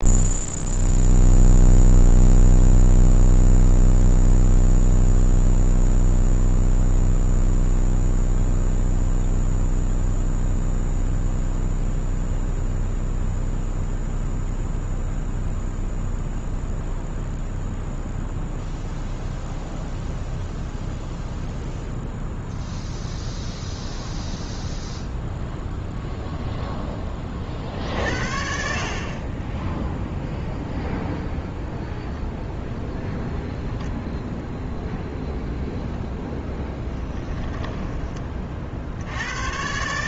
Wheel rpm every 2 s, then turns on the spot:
0, 0, 0, 0, 0, 0, 0, 0, 0, 0, 0, 0, 0, 10, 40, 0, 0, 0, 10, 50.
36-38